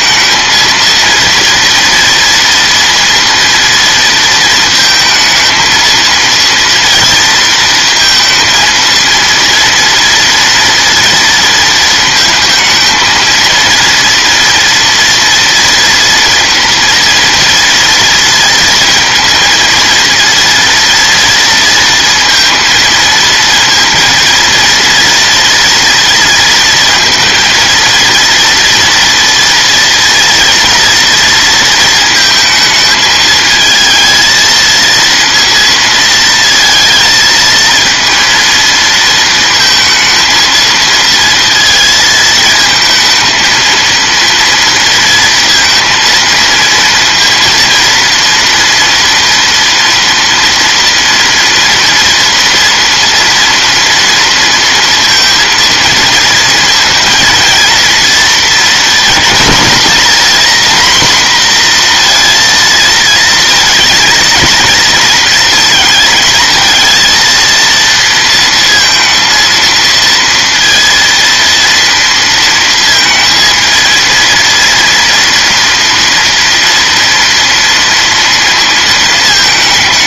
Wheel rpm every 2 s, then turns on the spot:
230, 230, 230, 230, 230, 230, 230, 240, 230, 230, 230, 230, 230, 230, 240, 230, 220, 230, 230, 230, 230, 220, 230, 230, 230, 230, 240, 230, 230, 220, 240, 230, 230, 230, 230, 230, 230, 230, 230, 220.
none